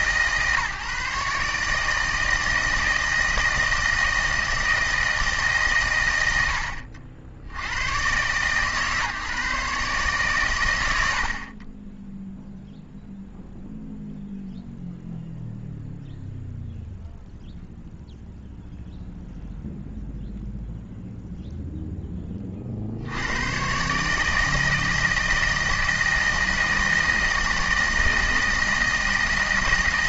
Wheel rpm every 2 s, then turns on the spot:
150, 160, 160, 70, 140, 100, 0, 0, 0, 0, 0, 60, 160, 160, 160.
none